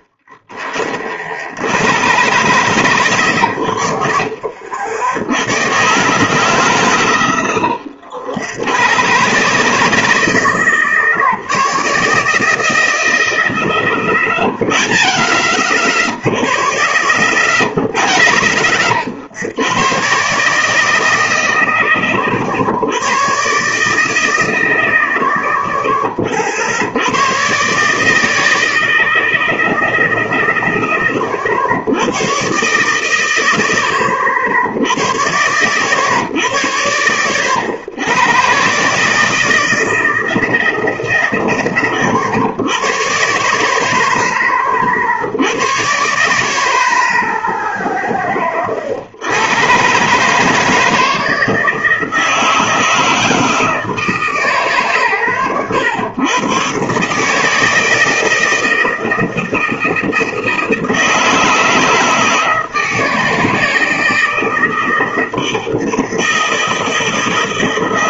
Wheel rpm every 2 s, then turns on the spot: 20, 120, 60, 140, 90, 160, 150, 100, 40, 80, 140, 110, 100, 60, 160, 130, 110, 60, 80, 130, 160, 100, 30, 40, 30, 160, 160, 140, 120, 160, 160, 160, 160, 160.
none